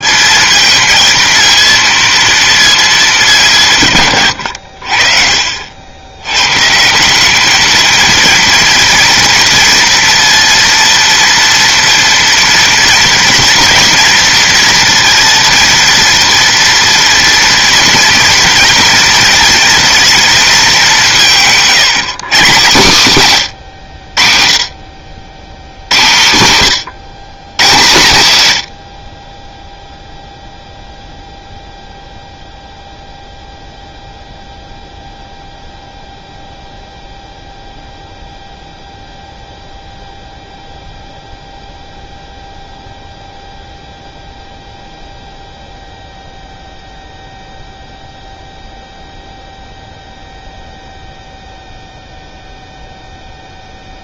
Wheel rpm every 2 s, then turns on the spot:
230, 210, 60, 160, 230, 230, 230, 230, 230, 230, 200, 150, 50, 140, 70, 0, 0, 0, 0, 0, 0, 0, 0, 0, 0, 0, 0.
none